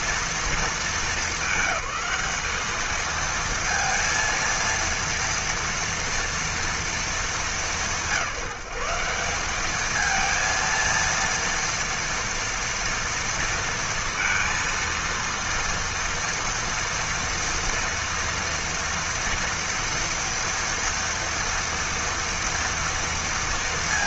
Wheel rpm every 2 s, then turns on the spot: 220, 210, 230, 230, 180, 230, 230, 230, 230, 240, 230, 230.
none